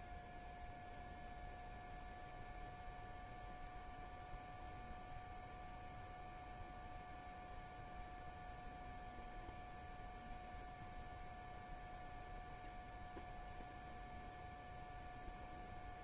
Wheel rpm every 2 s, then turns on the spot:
0, 0, 0, 0, 0, 0, 0, 0.
none